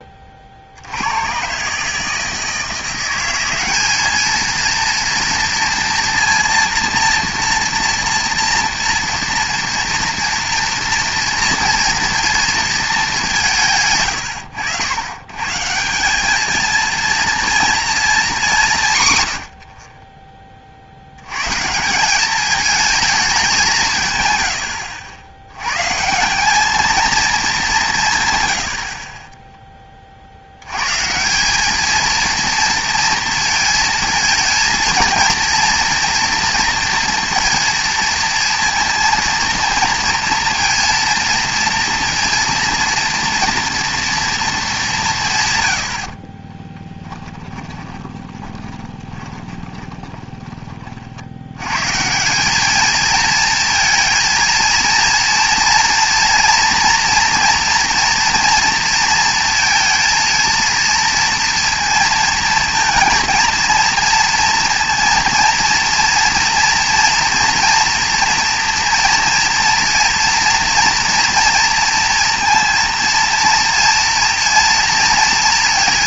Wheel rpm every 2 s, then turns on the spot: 60, 170, 230, 230, 230, 240, 230, 100, 220, 170, 40, 210, 100, 200, 80, 100, 230, 220, 230, 230, 230, 230, 220, 20, 20, 30, 210, 230, 230, 230, 230, 230, 230, 240, 230, 230, 230, 230.
46-50